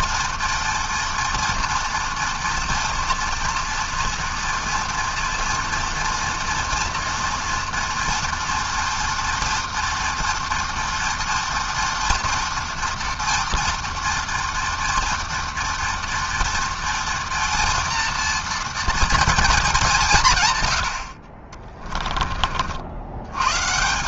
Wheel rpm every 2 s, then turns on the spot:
230, 240, 240, 230, 230, 230, 230, 230, 230, 230, 60, 110.
none